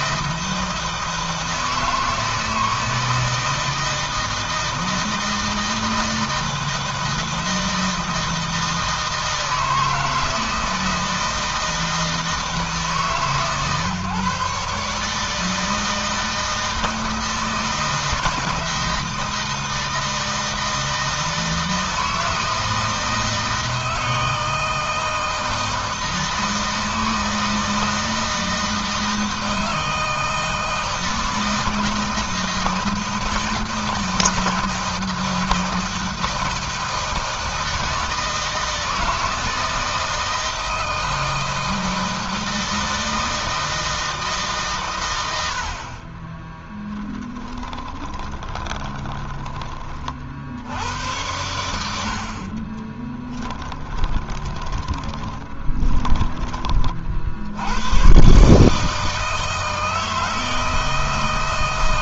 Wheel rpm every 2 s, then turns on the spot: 160, 160, 160, 160, 160, 160, 160, 150, 160, 160, 160, 160, 160, 160, 160, 160, 160, 160, 160, 160, 160, 160, 140, 20, 20, 80, 40, 20, 30, 140, 160.
46-50 52-56